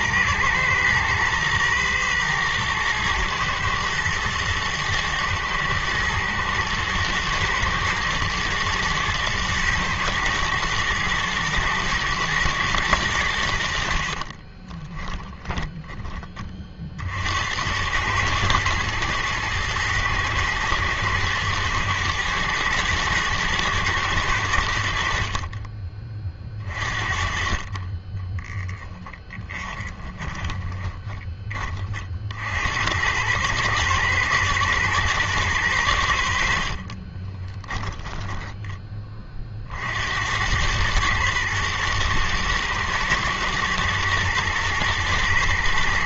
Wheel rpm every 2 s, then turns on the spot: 120, 120, 110, 110, 120, 110, 110, 20, 40, 110, 110, 110, 80, 40, 10, 10, 70, 120, 40, 10, 100, 110, 110.
14-16 28-32